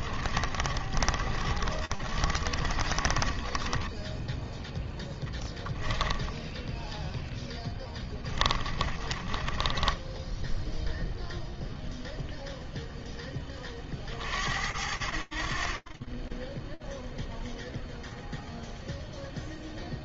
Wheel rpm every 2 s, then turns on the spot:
30, 30, 10, 0, 20, 0, 0, 60, 0, 0.
0-6 8-10